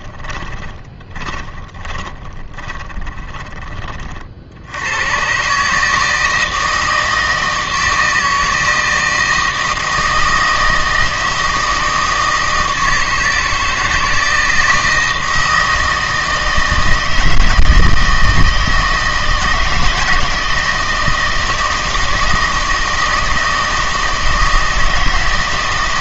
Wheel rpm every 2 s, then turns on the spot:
20, 30, 80, 160, 160, 160, 160, 160, 160, 160, 160, 160, 160.
0-4